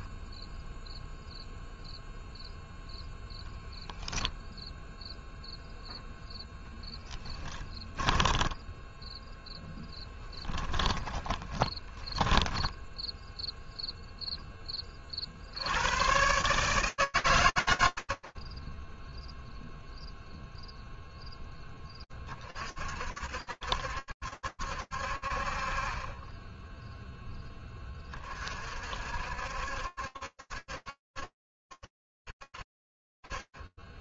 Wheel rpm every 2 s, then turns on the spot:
0, 10, 0, 10, 0, 20, 10, 50, 150, 0, 10, 60, 60, 10, 60, 70, 60.
6-8 10-12